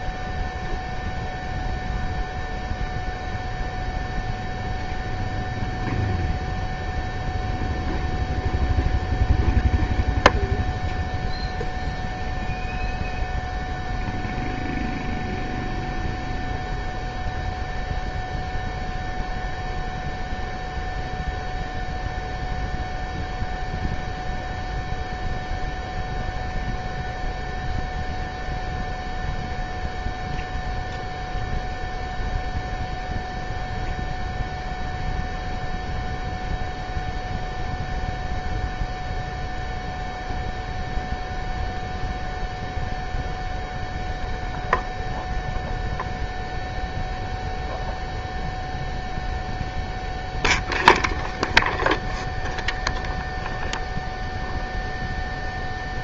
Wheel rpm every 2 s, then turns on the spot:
0, 0, 0, 0, 0, 0, 0, 0, 0, 0, 0, 0, 0, 0, 0, 0, 0, 0, 0, 0, 0, 0, 0, 0, 0, 0, 0, 0.
none